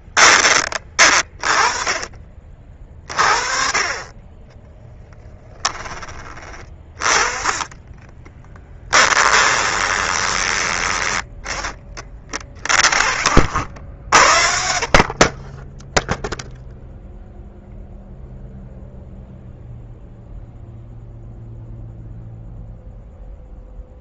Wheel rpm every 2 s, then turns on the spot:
30, 40, 10, 30, 20, 20, 50, 50, 0, 0, 0, 0.
4-6 8-14